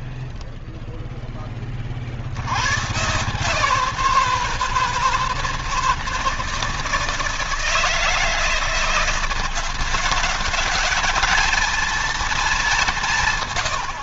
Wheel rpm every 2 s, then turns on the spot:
0, 110, 160, 160, 160, 200, 190.
none